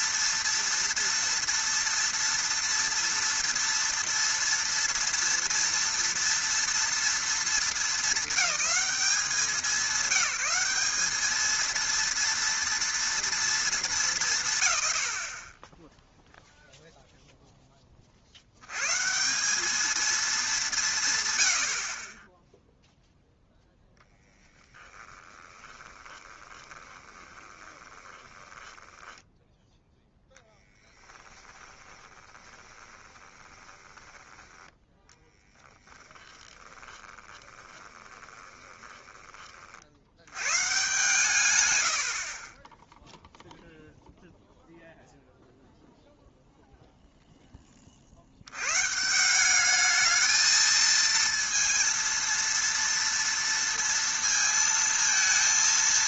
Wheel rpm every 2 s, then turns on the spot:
230, 230, 230, 230, 220, 200, 230, 140, 0, 100, 200, 0, 0, 20, 10, 10, 20, 10, 30, 20, 120, 20, 0, 0, 100, 220, 230, 230.
26-34 36-40